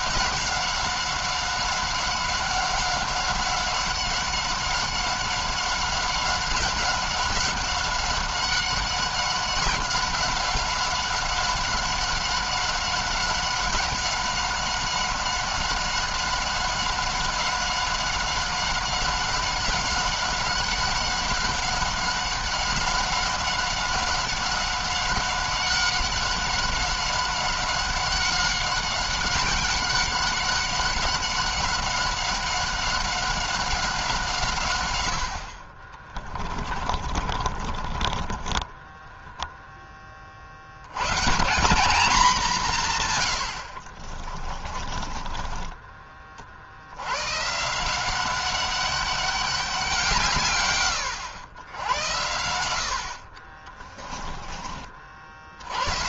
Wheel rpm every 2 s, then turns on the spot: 190, 190, 190, 190, 190, 190, 190, 190, 190, 200, 190, 190, 200, 190, 190, 190, 190, 110, 40, 10, 110, 150, 30, 90, 200, 120, 70, 40.
36-40 44-46